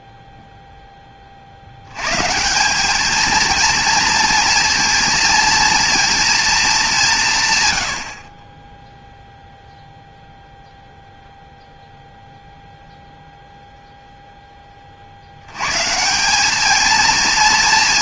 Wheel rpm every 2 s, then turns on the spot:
0, 170, 230, 220, 20, 0, 0, 10, 210.
none